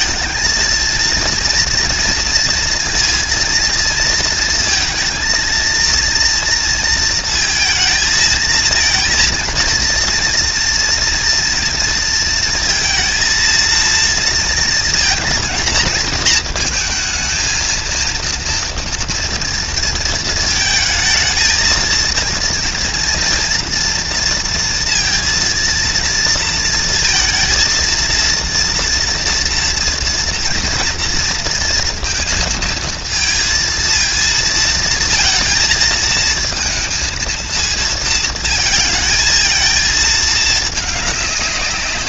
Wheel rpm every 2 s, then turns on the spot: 230, 230, 230, 230, 220, 230, 230, 230, 230, 240, 220, 230, 230, 230, 230, 230, 220, 230, 230, 220, 210.
none